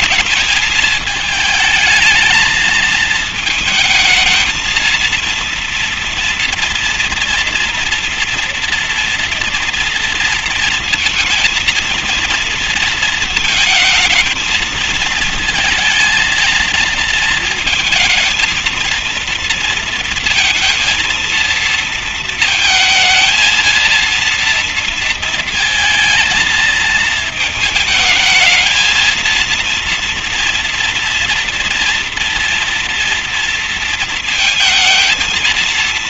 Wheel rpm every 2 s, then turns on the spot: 220, 220, 230, 230, 230, 230, 230, 220, 230, 220, 230, 230, 230, 230, 220, 230, 230, 220.
none